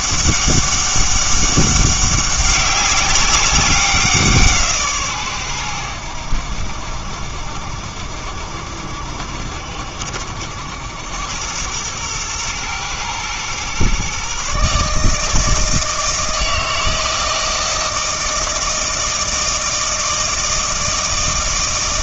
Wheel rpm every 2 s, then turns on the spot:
200, 200, 150, 70, 70, 80, 110, 140, 160, 160, 160.
none